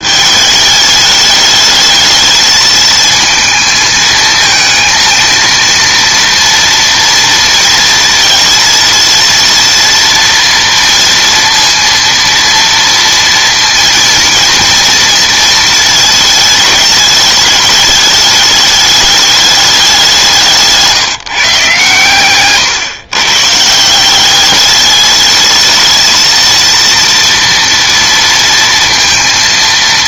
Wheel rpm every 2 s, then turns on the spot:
210, 220, 220, 230, 230, 230, 230, 230, 210, 210, 160, 130, 200, 230, 230.
20-22